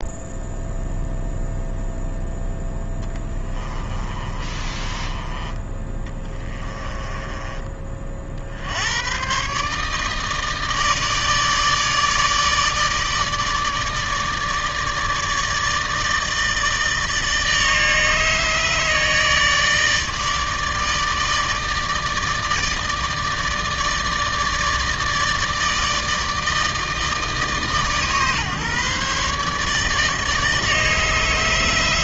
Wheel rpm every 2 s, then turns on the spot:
0, 10, 20, 20, 100, 150, 150, 150, 160, 150, 160, 150, 160, 160, 140, 150.
2-8